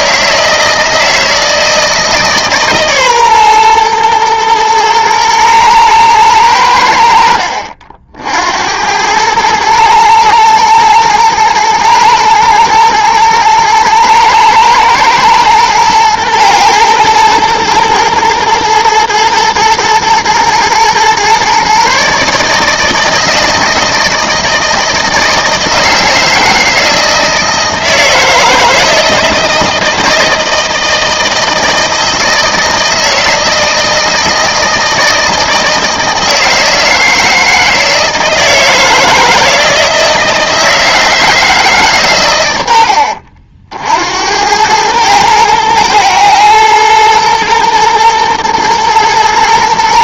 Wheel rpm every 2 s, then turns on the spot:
160, 140, 110, 90, 80, 110, 110, 110, 110, 120, 120, 150, 160, 160, 160, 160, 160, 160, 160, 160, 160, 90, 100, 110, 120.
none